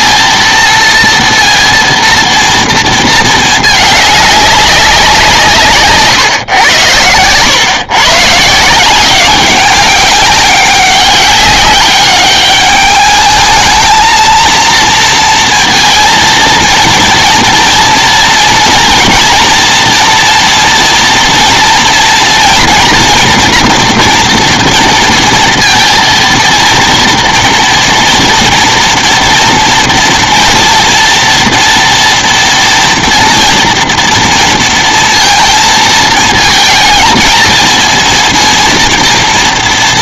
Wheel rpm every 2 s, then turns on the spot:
230, 230, 200, 130, 140, 190, 200, 220, 230, 230, 230, 230, 230, 230, 230, 230, 230, 230, 220, 230.
none